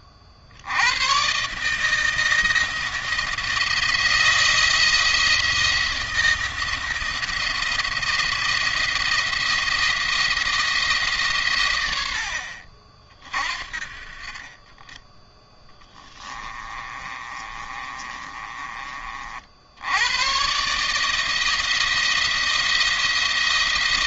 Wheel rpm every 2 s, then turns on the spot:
90, 160, 170, 170, 170, 150, 50, 20, 30, 40, 150, 170.
16-18